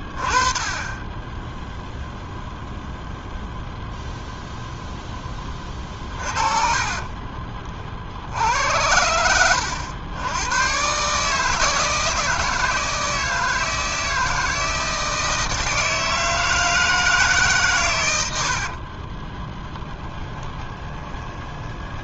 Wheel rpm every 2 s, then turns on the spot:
20, 0, 0, 40, 80, 120, 160, 160, 160, 50, 20.
6-8 18-22